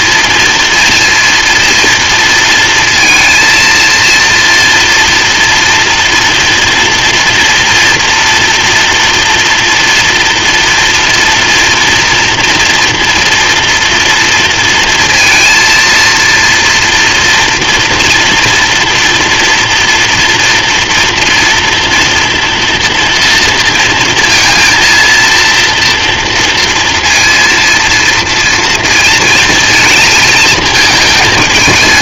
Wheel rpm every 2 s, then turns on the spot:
230, 230, 230, 230, 230, 230, 240, 230, 230, 230, 230, 230, 230, 230, 230, 220.
none